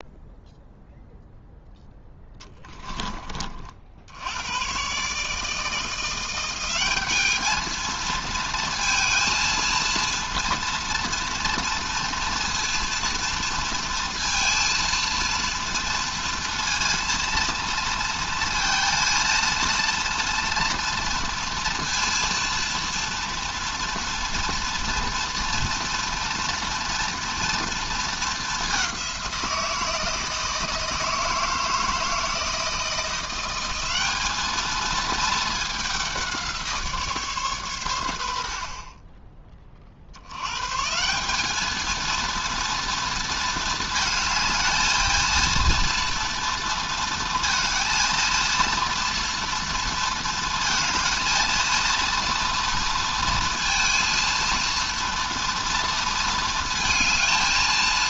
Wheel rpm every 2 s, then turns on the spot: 0, 10, 120, 190, 220, 230, 230, 230, 230, 230, 230, 230, 230, 230, 200, 160, 160, 220, 160, 40, 140, 230, 220, 230, 230, 230, 230, 230, 230.
2-4